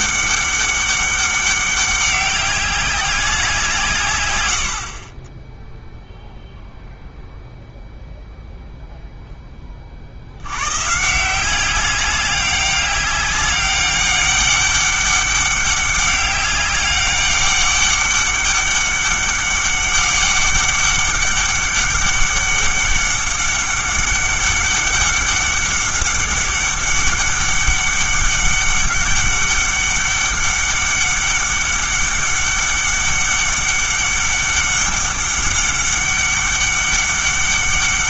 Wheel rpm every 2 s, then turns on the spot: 200, 200, 70, 0, 0, 120, 190, 200, 200, 200, 200, 200, 200, 200, 200, 200, 200, 200, 200.
4-6